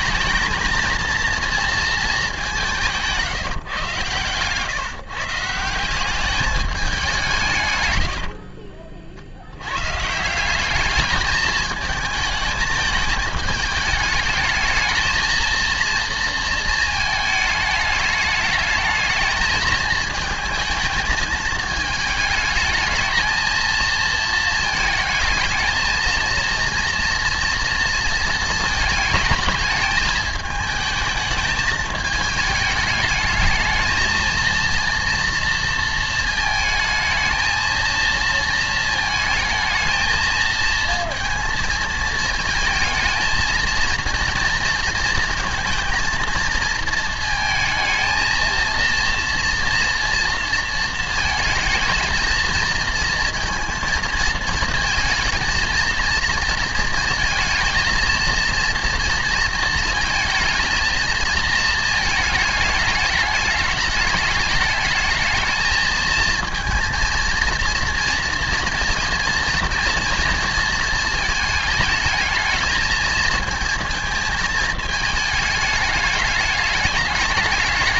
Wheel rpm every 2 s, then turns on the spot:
220, 190, 130, 200, 60, 180, 220, 220, 230, 220, 220, 210, 220, 230, 220, 220, 210, 230, 220, 230, 220, 230, 230, 230, 230, 240, 220, 220, 230, 230, 220, 220, 210, 230, 230, 230, 220, 220, 210.
8-10